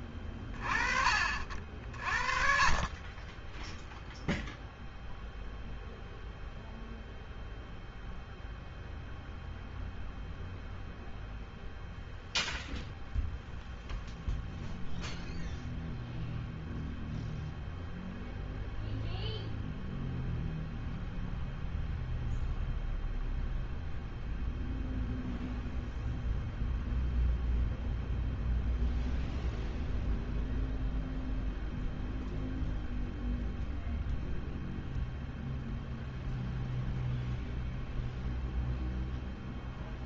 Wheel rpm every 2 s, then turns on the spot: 20, 20, 0, 0, 0, 0, 0, 0, 0, 0, 0, 0, 0, 0, 0, 0, 0, 0, 0, 0.
none